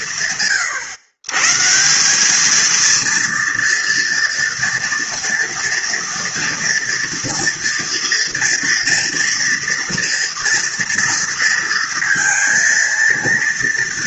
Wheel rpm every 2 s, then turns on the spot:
130, 230, 230, 230, 230, 230, 230.
none